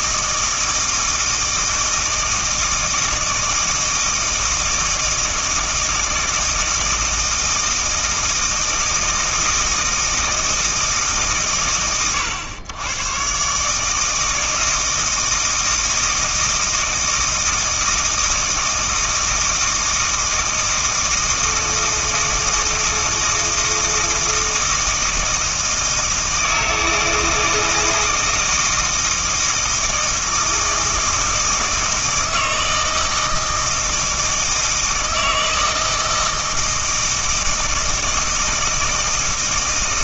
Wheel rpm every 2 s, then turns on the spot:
160, 160, 160, 160, 160, 160, 110, 160, 160, 160, 160, 160, 160, 160, 160, 160, 160, 160, 160, 160.
none